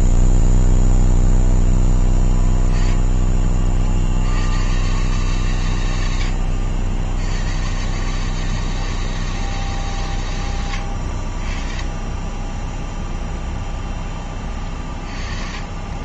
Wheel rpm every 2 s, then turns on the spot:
0, 10, 100, 80, 150, 100, 10, 30.
14-16